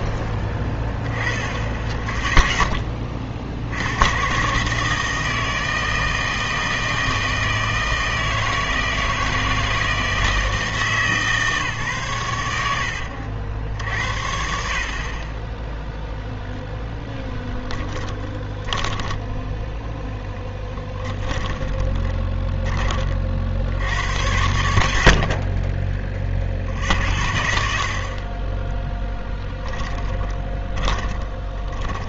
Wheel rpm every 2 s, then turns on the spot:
10, 10, 150, 160, 160, 160, 90, 60, 10, 20, 10, 20, 90, 60, 20, 20.
16-22 30-32